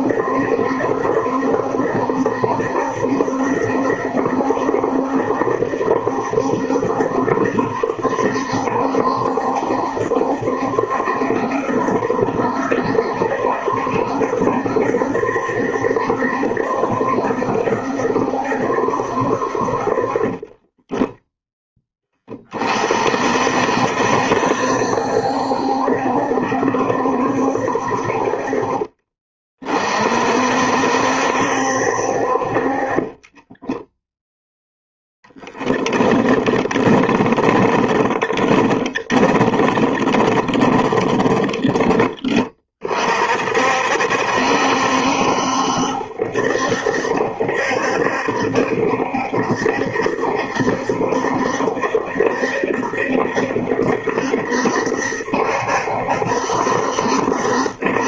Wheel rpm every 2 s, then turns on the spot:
70, 70, 70, 70, 70, 70, 70, 70, 70, 70, 20, 40, 70, 70, 40, 60, 40, 0, 10, 20, 20, 40, 70, 70, 70, 70, 70, 70, 70.
20-22 36-42